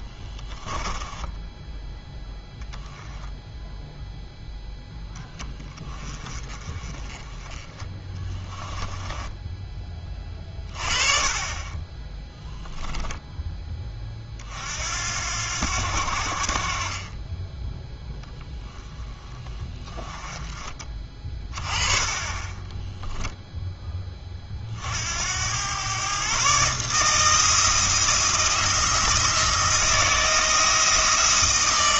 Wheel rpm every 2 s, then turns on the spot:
10, 0, 10, 30, 10, 30, 0, 70, 40, 10, 30, 10, 60, 150, 170, 170.
0-2 8-10 22-24